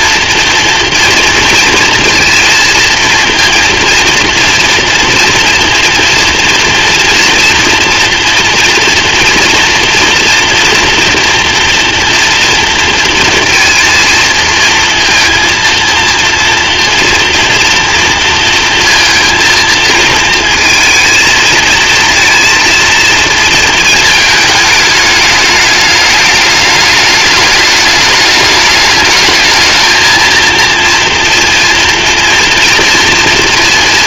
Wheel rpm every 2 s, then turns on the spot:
230, 220, 230, 240, 240, 230, 230, 230, 230, 230, 220, 230, 210, 210, 210, 230, 230.
none